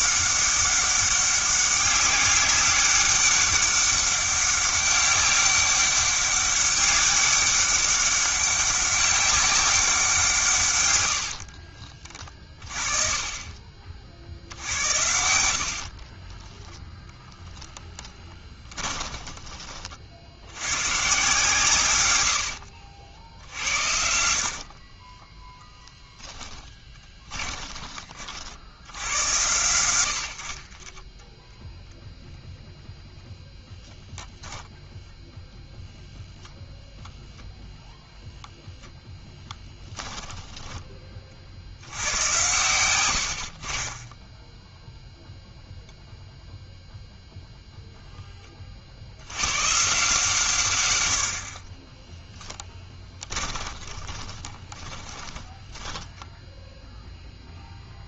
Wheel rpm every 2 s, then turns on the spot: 200, 200, 200, 200, 200, 130, 30, 70, 0, 20, 90, 80, 50, 20, 80, 40, 0, 0, 0, 0, 30, 100, 0, 0, 40, 120, 10, 20, 0.
18-20 22-24 26-28 40-42 52-56